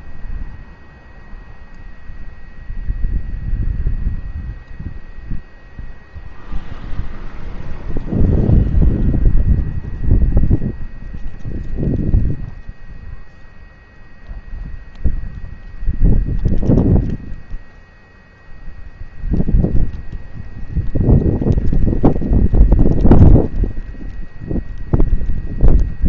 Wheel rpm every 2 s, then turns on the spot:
0, 0, 0, 0, 0, 0, 0, 0, 0, 0, 0, 0, 0.
none